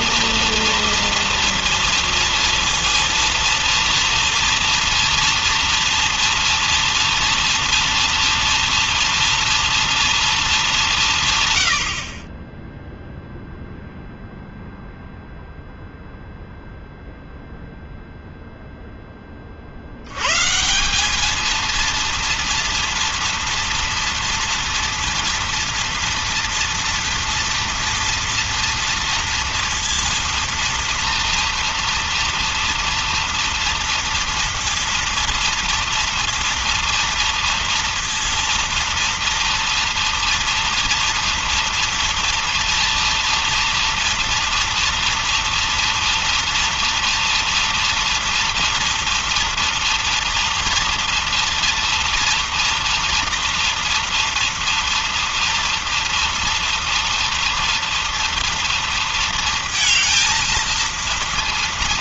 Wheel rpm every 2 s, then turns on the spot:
230, 230, 230, 230, 230, 220, 20, 0, 0, 0, 120, 230, 230, 230, 230, 230, 230, 230, 230, 230, 240, 230, 230, 230, 230, 230, 230, 230, 230, 230, 230.
none